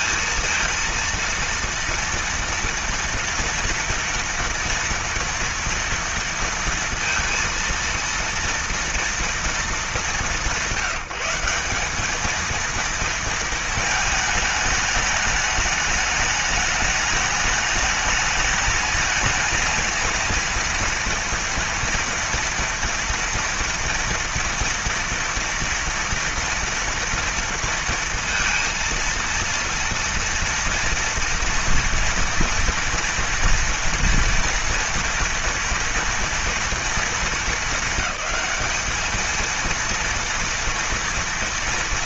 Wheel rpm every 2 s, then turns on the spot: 230, 230, 230, 230, 230, 190, 230, 210, 210, 220, 230, 230, 240, 230, 230, 240, 230, 230, 230, 220, 230.
none